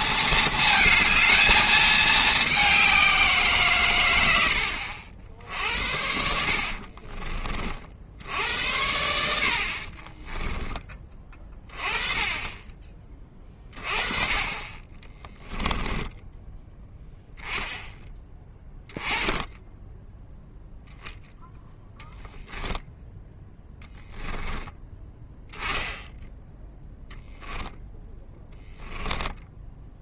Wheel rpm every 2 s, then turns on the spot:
220, 190, 80, 50, 80, 20, 20, 20, 10, 10, 0, 0, 10, 0, 10.
6-8